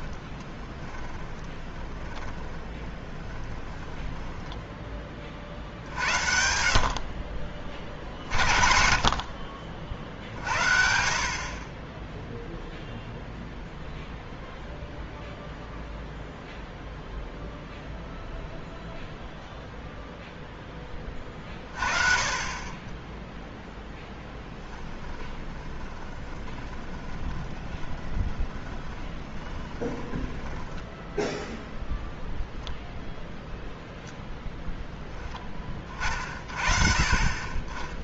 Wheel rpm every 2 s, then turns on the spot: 10, 30, 10, 70, 50, 70, 0, 0, 0, 0, 10, 20, 10, 20, 20, 10, 0, 0, 30.
0-6 24-32